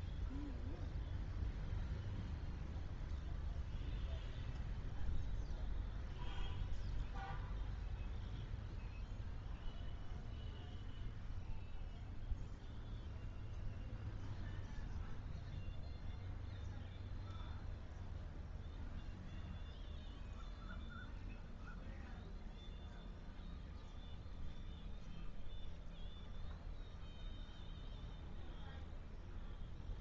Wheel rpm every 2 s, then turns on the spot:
0, 0, 0, 0, 0, 0, 0, 0, 0, 0, 0, 0, 0, 0, 0.
none